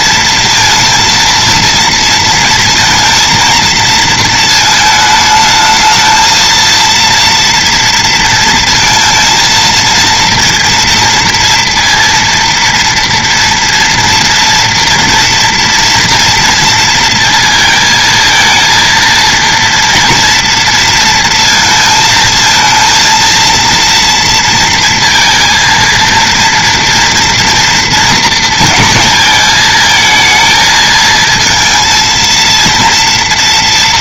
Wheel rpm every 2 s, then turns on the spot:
230, 230, 220, 230, 230, 230, 230, 230, 230, 230, 230, 230, 230, 230, 230, 220, 230.
none